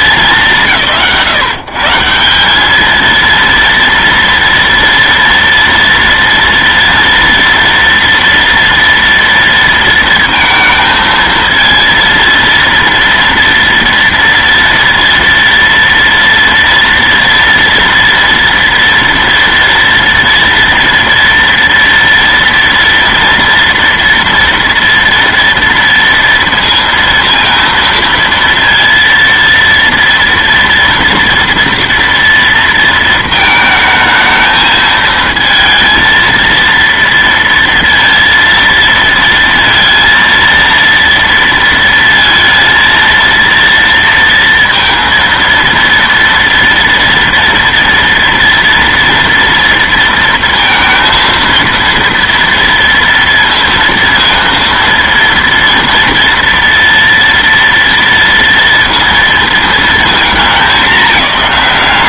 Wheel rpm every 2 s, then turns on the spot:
200, 180, 230, 240, 230, 230, 230, 230, 230, 240, 230, 230, 230, 230, 230, 230, 230, 220, 230, 230, 230, 230, 230, 230, 230, 230, 230, 230, 230, 230, 220.
none